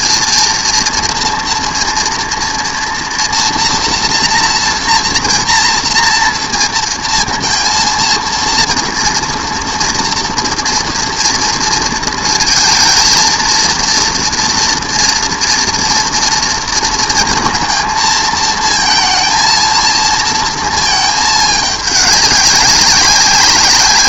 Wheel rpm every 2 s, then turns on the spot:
230, 230, 230, 230, 230, 230, 220, 230, 230, 230, 230, 200.
none